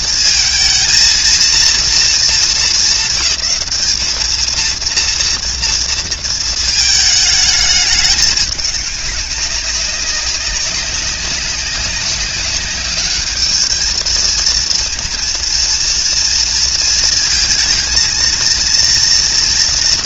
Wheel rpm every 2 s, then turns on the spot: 220, 200, 230, 220, 200, 190, 200, 230, 230, 230.
none